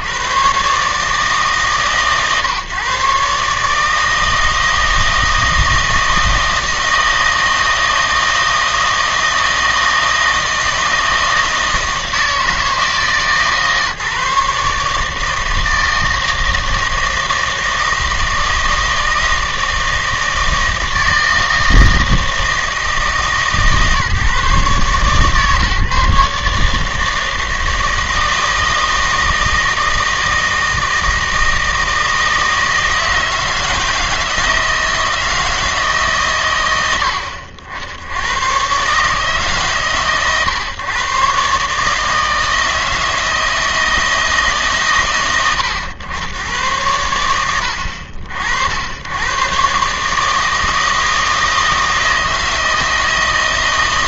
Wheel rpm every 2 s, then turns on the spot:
130, 130, 160, 160, 160, 160, 160, 140, 160, 160, 160, 160, 150, 150, 160, 160, 160, 160, 110, 120, 130, 160, 140, 110, 80, 160, 160.
none